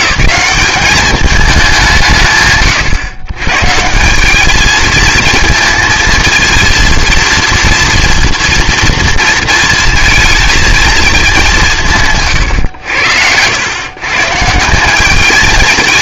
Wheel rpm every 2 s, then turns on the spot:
210, 130, 210, 230, 230, 230, 110, 180.
none